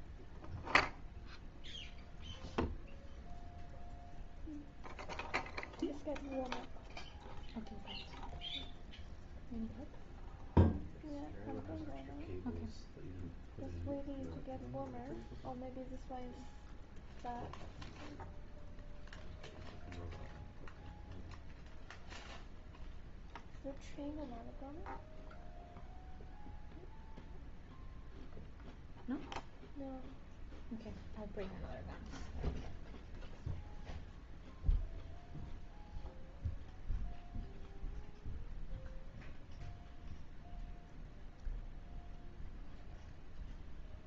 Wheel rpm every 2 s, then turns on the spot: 0, 0, 0, 0, 0, 0, 0, 0, 0, 0, 0, 0, 0, 0, 0, 0, 0, 0, 0, 0, 0, 0.
none